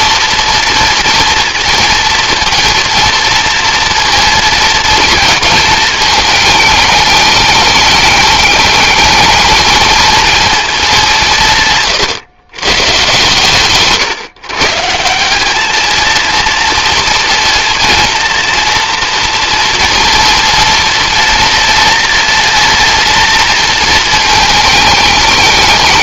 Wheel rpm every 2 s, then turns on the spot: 230, 230, 230, 210, 210, 220, 120, 140, 230, 240, 230, 230, 210.
none